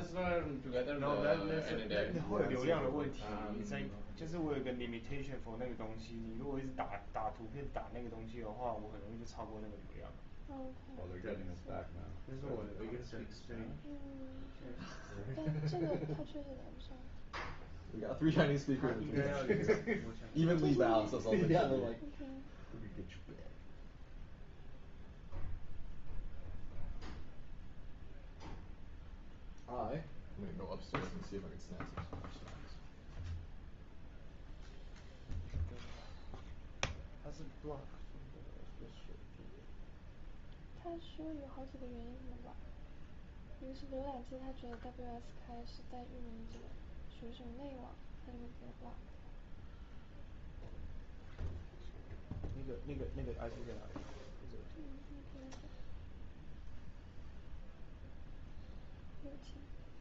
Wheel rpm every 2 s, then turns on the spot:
0, 0, 0, 0, 0, 0, 0, 0, 0, 0, 0, 0, 0, 0, 0, 0, 0, 0, 0, 0, 0, 0, 0, 0, 0, 0, 0, 0, 0, 0.
none